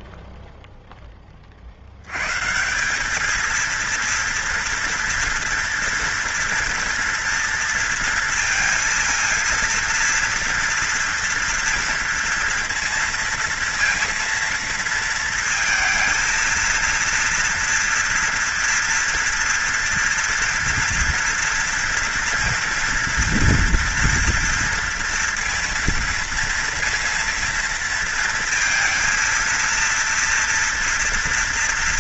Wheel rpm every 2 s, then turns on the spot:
10, 130, 230, 240, 230, 230, 230, 230, 230, 240, 230, 230, 230, 230, 230, 230.
none